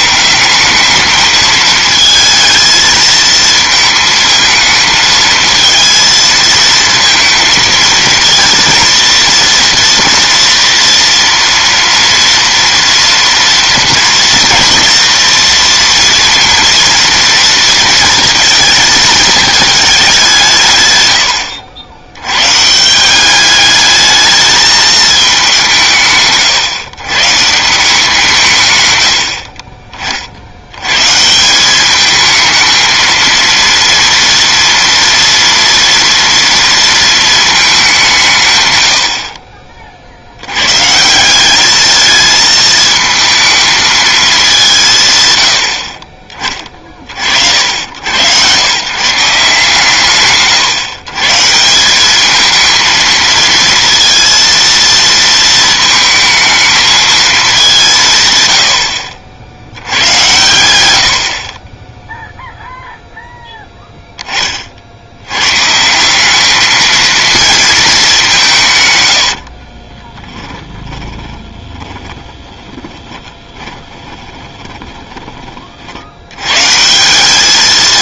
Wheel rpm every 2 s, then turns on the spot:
200, 220, 220, 230, 230, 230, 230, 230, 230, 220, 140, 140, 220, 140, 130, 90, 220, 230, 230, 130, 100, 220, 200, 30, 120, 150, 220, 230, 220, 100, 110, 0, 30, 200, 180, 10, 20, 20, 120.
70-76